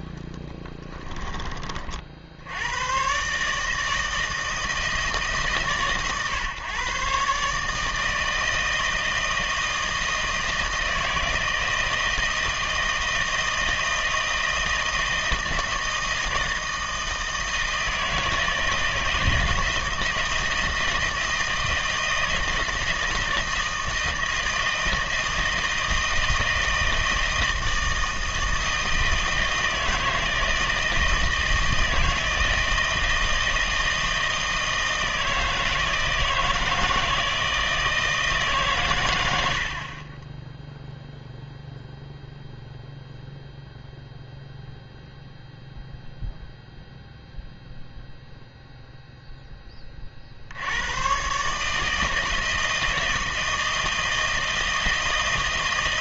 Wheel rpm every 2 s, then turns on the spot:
10, 100, 160, 130, 160, 160, 160, 160, 160, 160, 160, 160, 160, 160, 160, 160, 160, 160, 160, 150, 0, 0, 0, 0, 0, 90, 160, 160.
0-2